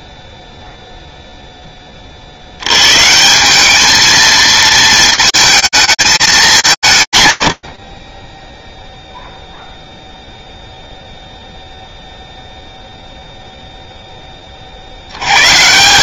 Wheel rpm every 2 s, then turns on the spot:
0, 90, 220, 170, 0, 0, 0, 80.
none